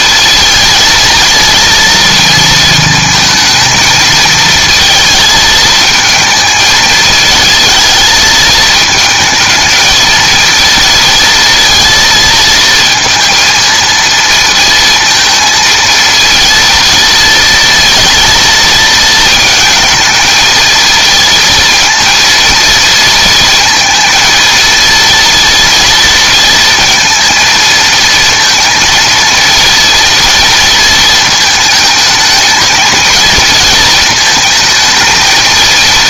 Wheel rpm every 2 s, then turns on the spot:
230, 230, 230, 220, 220, 230, 220, 230, 230, 230, 220, 230, 230, 230, 230, 230, 220, 220.
none